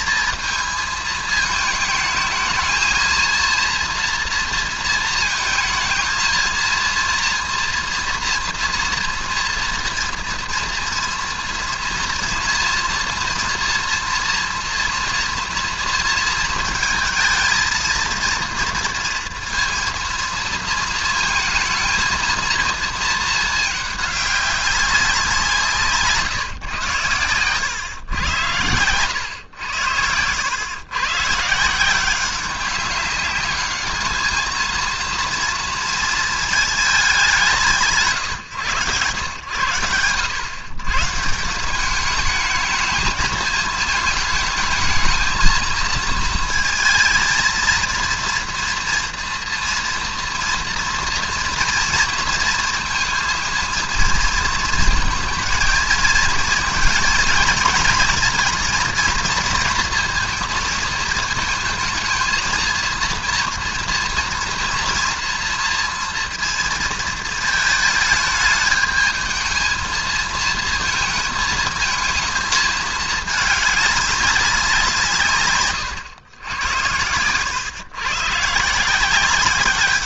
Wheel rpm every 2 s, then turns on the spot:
220, 220, 230, 230, 230, 230, 230, 230, 230, 230, 230, 230, 200, 130, 100, 120, 190, 220, 220, 120, 110, 210, 220, 230, 240, 230, 230, 230, 230, 230, 220, 230, 230, 230, 220, 220, 220, 180, 100, 150.
none